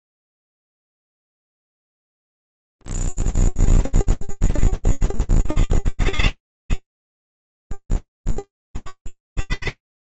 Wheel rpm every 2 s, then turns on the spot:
10, 10, 20, 20, 20.
none